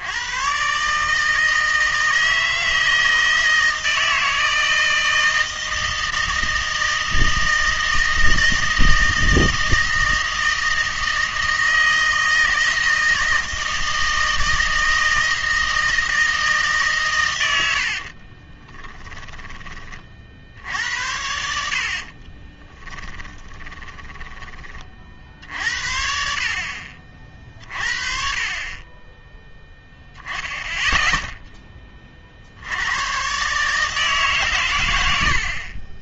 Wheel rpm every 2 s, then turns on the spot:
120, 160, 160, 160, 160, 160, 160, 160, 150, 20, 70, 20, 30, 60, 30, 0, 70, 120.
18-20 22-24